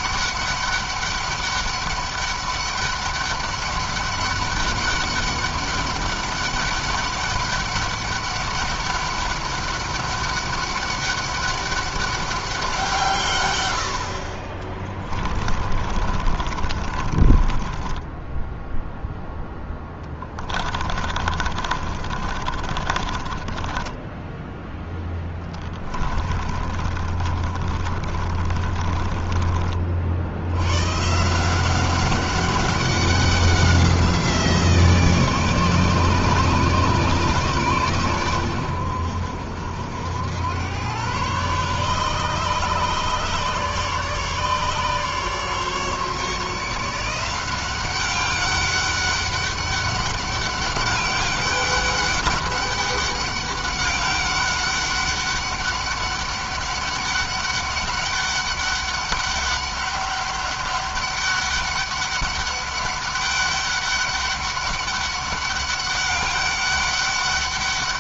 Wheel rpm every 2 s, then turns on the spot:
200, 200, 200, 200, 200, 200, 170, 30, 30, 0, 30, 30, 10, 40, 30, 100, 190, 160, 150, 90, 110, 140, 140, 160, 190, 200, 200, 200, 200, 200, 200, 200, 200, 200.
14-18 20-24 26-30